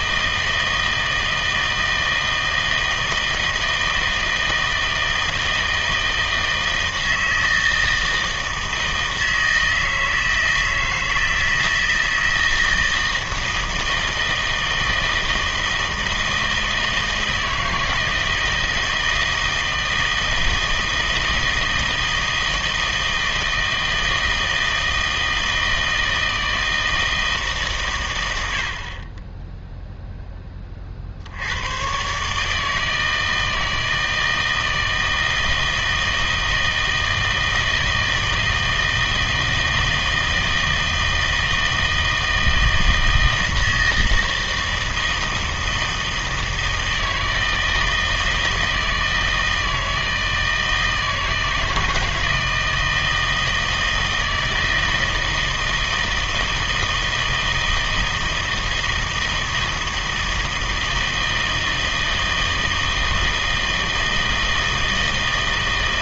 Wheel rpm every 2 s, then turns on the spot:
160, 170, 160, 160, 160, 160, 160, 160, 160, 160, 160, 160, 160, 160, 80, 30, 150, 160, 160, 160, 160, 160, 160, 160, 160, 160, 160, 160, 160, 160, 160, 160, 160.
none